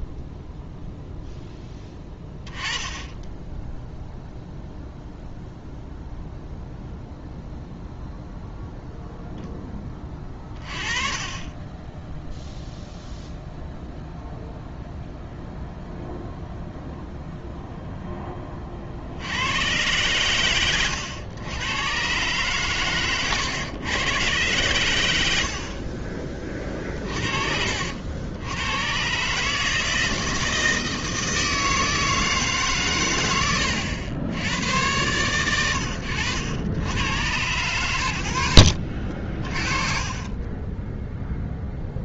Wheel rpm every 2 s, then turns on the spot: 0, 10, 0, 0, 0, 30, 0, 0, 0, 30, 100, 120, 110, 30, 100, 160, 130, 100, 100, 50, 20.
20-22 38-40